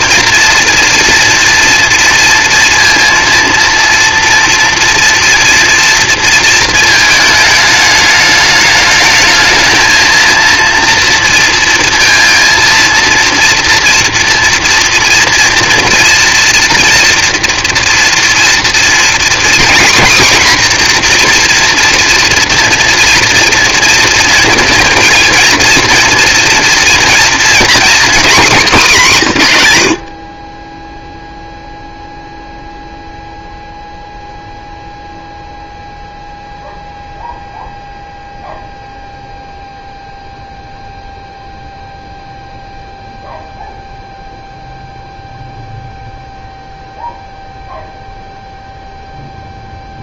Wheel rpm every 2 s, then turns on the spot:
230, 230, 230, 220, 210, 230, 230, 240, 230, 240, 250, 240, 230, 240, 210, 20, 0, 0, 0, 0, 0, 0, 0, 0, 0.
none